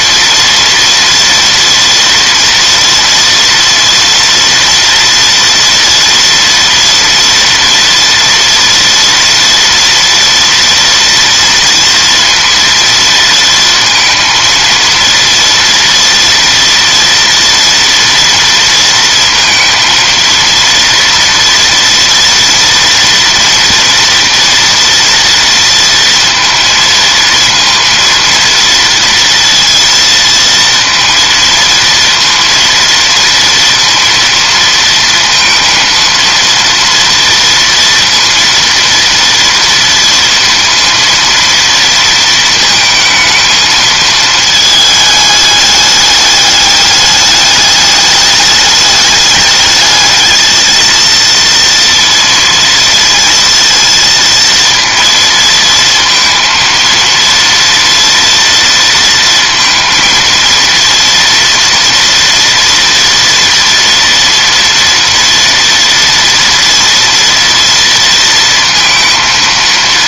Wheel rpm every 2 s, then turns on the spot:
230, 230, 230, 230, 230, 230, 230, 230, 230, 230, 230, 230, 240, 230, 230, 230, 230, 230, 230, 230, 230, 230, 210, 210, 210, 220, 230, 230, 230, 230, 230, 230, 230, 230, 230.
none